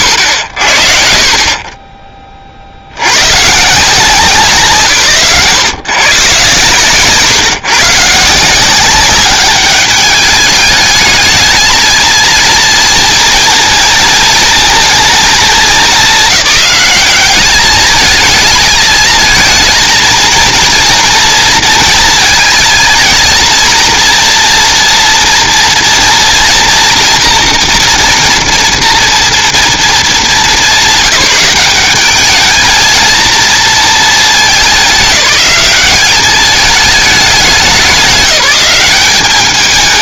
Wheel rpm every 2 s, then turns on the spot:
60, 50, 160, 130, 180, 210, 230, 230, 200, 220, 230, 230, 230, 230, 230, 190, 220, 200, 210, 190.
none